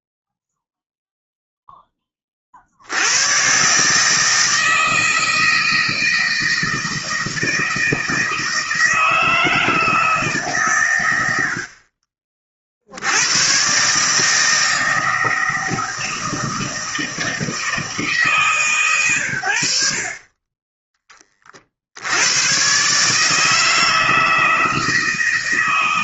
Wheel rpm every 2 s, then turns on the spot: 0, 50, 160, 160, 160, 140, 50, 160, 160, 150, 20, 110, 160.
none